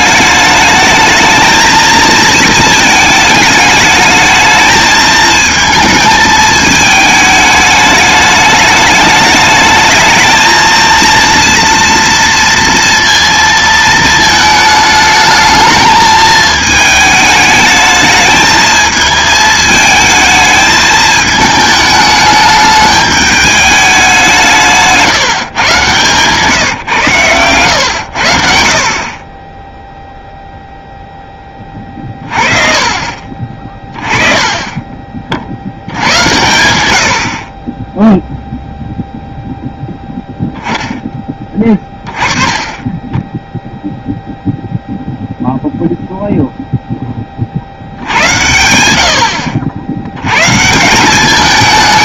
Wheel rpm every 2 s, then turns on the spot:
210, 220, 220, 220, 210, 230, 230, 220, 220, 220, 220, 210, 170, 140, 60, 0, 40, 20, 90, 0, 10, 20, 0, 0, 90, 150.
none